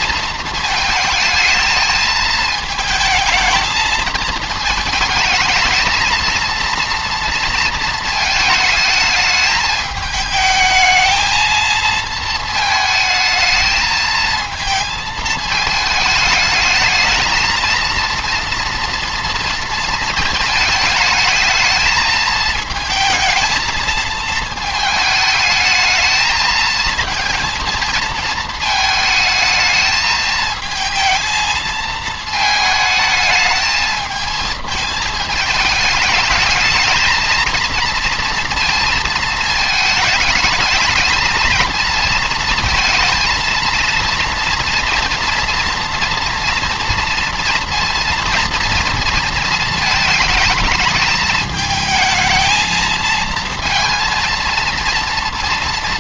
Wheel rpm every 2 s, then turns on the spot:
220, 220, 220, 230, 220, 220, 220, 220, 220, 230, 220, 220, 220, 220, 220, 220, 220, 220, 210, 230, 220, 230, 230, 240, 230, 220, 220, 230.
none